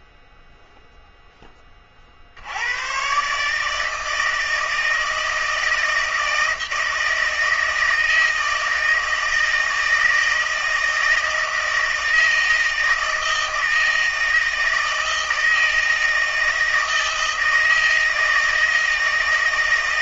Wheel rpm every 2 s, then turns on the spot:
0, 80, 160, 160, 160, 160, 160, 160, 160, 160.
none